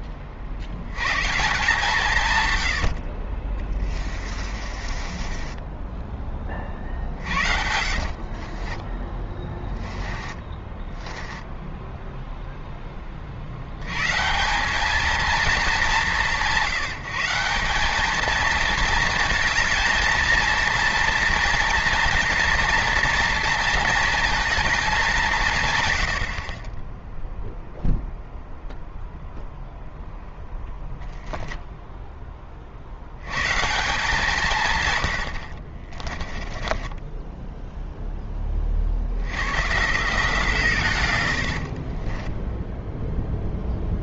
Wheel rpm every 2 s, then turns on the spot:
100, 70, 30, 40, 30, 10, 20, 210, 160, 220, 230, 230, 220, 30, 0, 10, 60, 160, 20, 50, 150, 10.
4-6 8-12 36-38 42-44